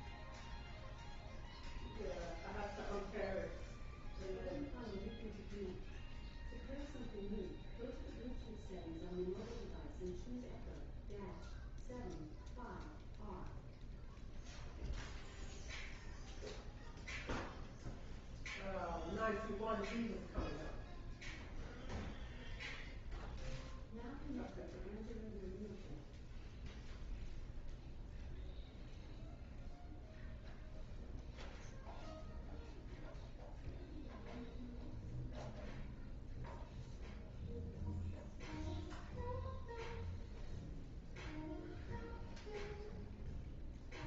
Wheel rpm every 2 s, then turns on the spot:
0, 0, 0, 0, 0, 0, 0, 0, 0, 0, 0, 0, 0, 0, 0, 0, 0, 0, 0, 0, 0, 0.
none